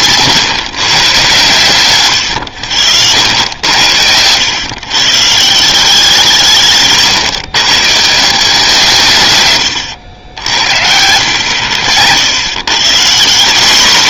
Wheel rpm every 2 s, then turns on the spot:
140, 90, 120, 160, 160, 80, 120.
none